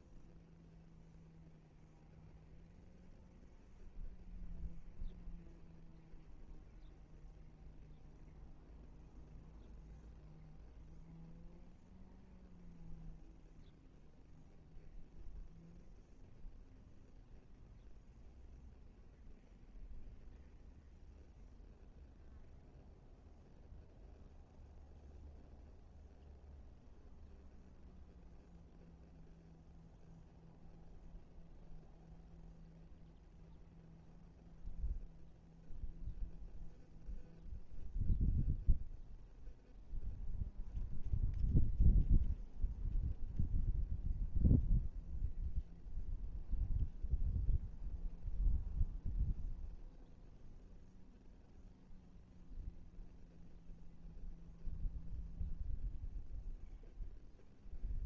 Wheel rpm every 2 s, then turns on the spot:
0, 0, 0, 0, 0, 0, 0, 0, 0, 0, 0, 0, 0, 0, 0, 0, 0, 0, 0, 0, 0, 0, 0, 0, 0, 0, 0, 0, 0.
none